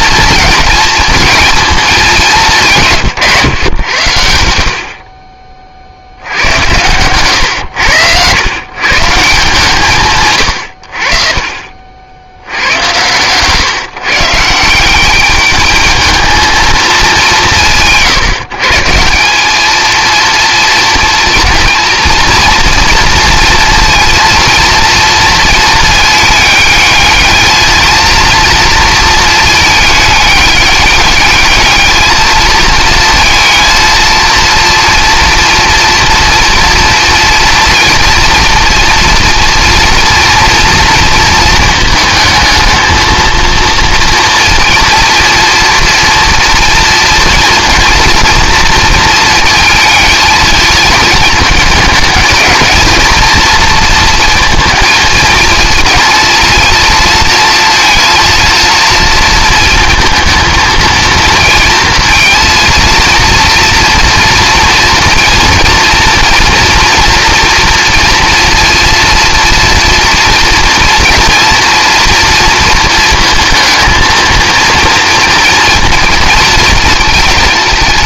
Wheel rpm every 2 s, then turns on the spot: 220, 160, 60, 110, 140, 70, 100, 180, 220, 160, 230, 230, 230, 220, 230, 210, 220, 230, 230, 230, 230, 220, 230, 230, 230, 220, 230, 230, 230, 230, 230, 230, 230, 240, 230, 230, 230, 230, 230.
6-8